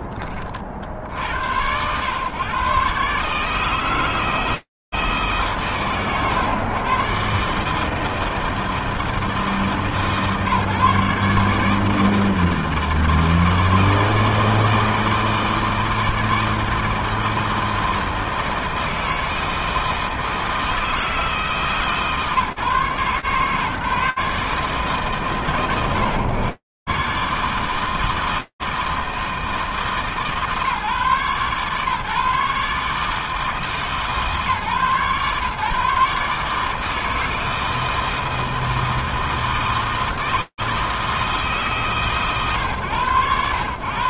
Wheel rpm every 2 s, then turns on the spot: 20, 130, 160, 130, 160, 140, 160, 160, 160, 160, 160, 150, 150, 130, 160, 150, 150, 140, 150, 160, 160, 120.
none